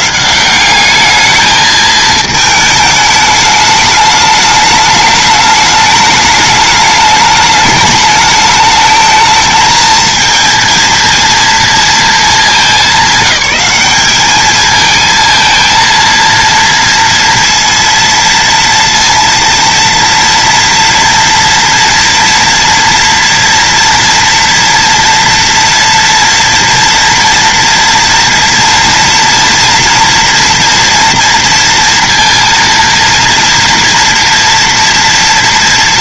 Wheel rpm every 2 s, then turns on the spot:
200, 220, 210, 210, 210, 230, 220, 210, 230, 230, 230, 240, 240, 230, 230, 230, 230, 230.
none